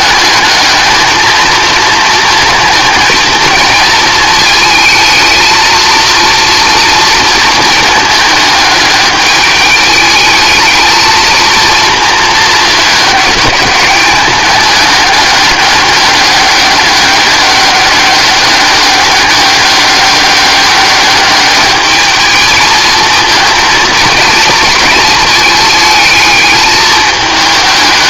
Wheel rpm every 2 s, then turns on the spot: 220, 230, 220, 230, 210, 220, 220, 210, 200, 200, 200, 220, 230, 210.
none